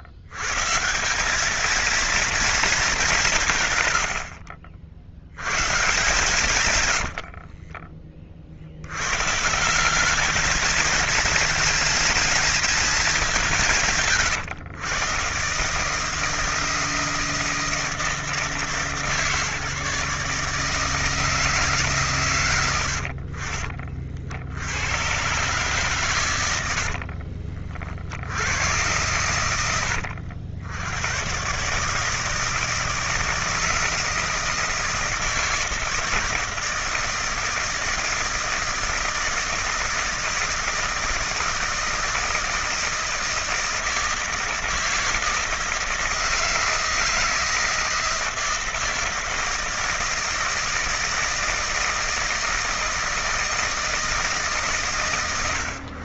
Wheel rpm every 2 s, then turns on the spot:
120, 220, 50, 120, 70, 220, 220, 140, 160, 160, 150, 110, 80, 90, 80, 90, 160, 160, 160, 160, 160, 160, 160, 160, 160, 160, 160, 130.
6-8